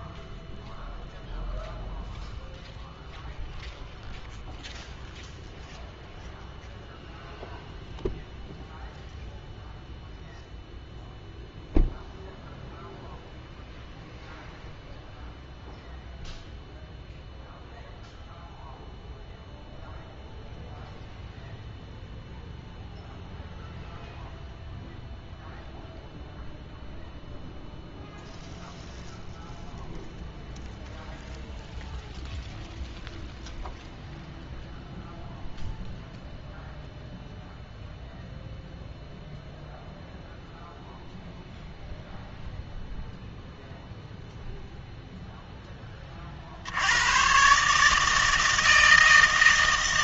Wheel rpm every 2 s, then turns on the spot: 0, 0, 0, 0, 0, 0, 0, 0, 0, 0, 0, 0, 0, 0, 0, 0, 0, 0, 0, 0, 0, 0, 0, 70, 160.
none